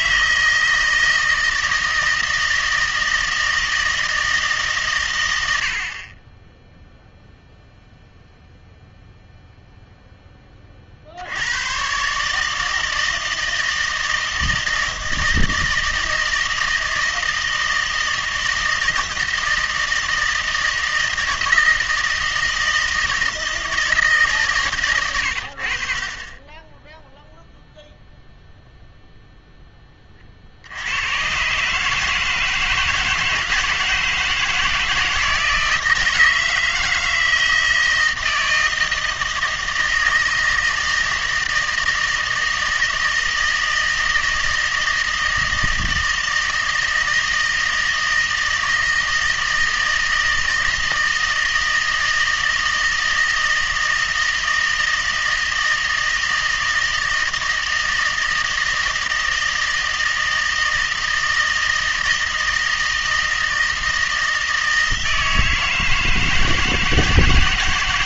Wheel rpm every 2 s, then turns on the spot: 160, 160, 130, 0, 0, 30, 160, 160, 160, 160, 160, 160, 130, 10, 0, 70, 160, 160, 160, 160, 160, 160, 160, 160, 160, 160, 160, 160, 160, 160, 160, 160, 160, 160.
none